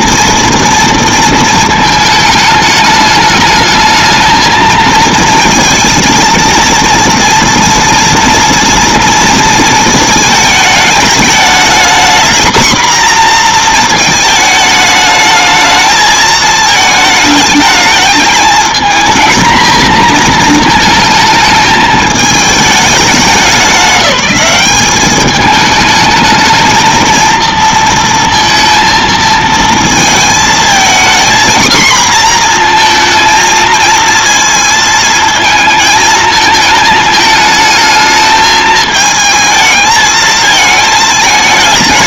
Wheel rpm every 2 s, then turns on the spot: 230, 210, 220, 230, 230, 210, 240, 220, 220, 220, 230, 210, 200, 220, 230, 230, 240, 230, 220, 220, 220.
none